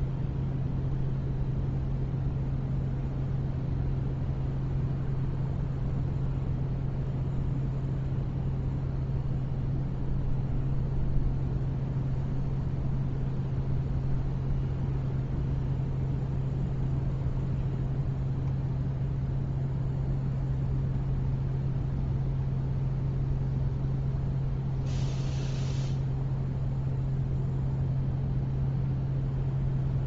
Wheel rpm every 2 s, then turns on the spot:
0, 0, 0, 0, 0, 0, 0, 0, 0, 0, 0, 0, 0, 0, 0.
none